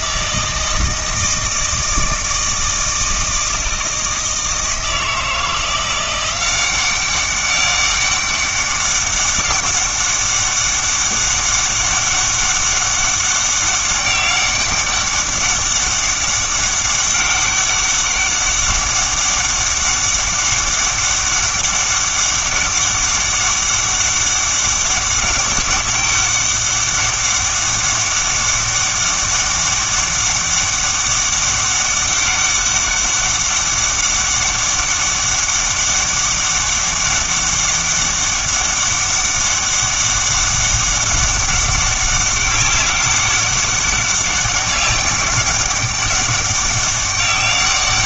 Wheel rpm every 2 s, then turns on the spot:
160, 160, 160, 190, 200, 200, 200, 190, 200, 200, 200, 190, 200, 200, 200, 200, 200, 200, 200, 200, 200, 200, 200, 190.
none